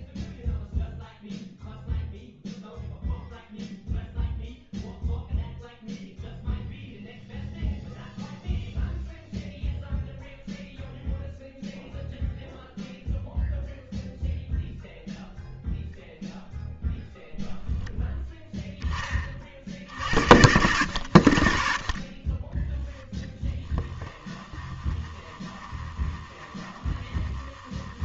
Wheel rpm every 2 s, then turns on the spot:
0, 0, 0, 0, 0, 0, 0, 0, 0, 10, 80, 10, 20, 20.
22-28